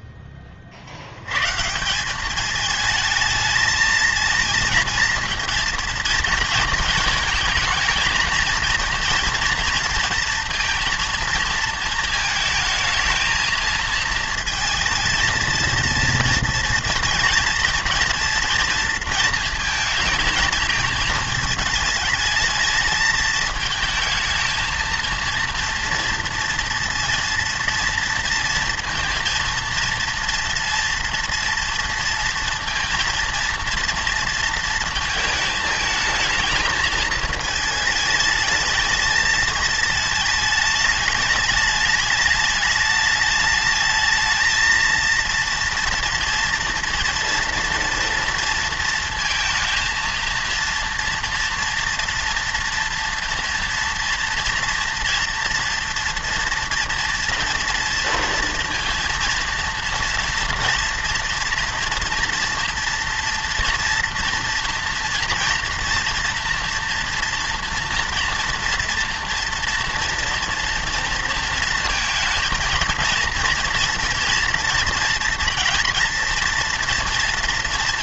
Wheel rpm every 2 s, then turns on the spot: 40, 210, 220, 220, 230, 230, 220, 220, 230, 230, 220, 220, 220, 230, 230, 230, 230, 230, 220, 220, 210, 210, 220, 230, 230, 230, 230, 230, 230, 230, 240, 240, 230, 230, 240, 230, 230, 230, 240.
none